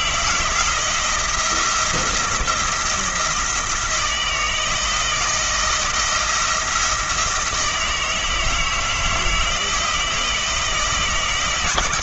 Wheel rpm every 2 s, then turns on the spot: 170, 170, 160, 170, 160, 160.
none